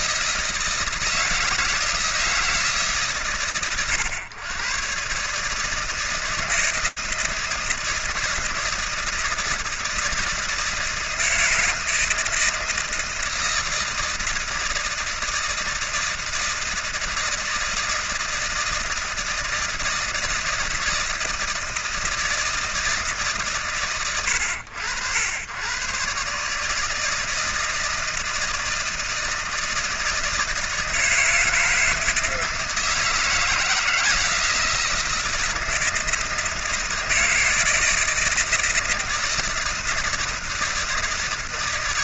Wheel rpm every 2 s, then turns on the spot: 160, 160, 110, 160, 160, 160, 160, 160, 160, 160, 160, 160, 90, 140, 160, 160, 160, 160, 160, 160, 160.
none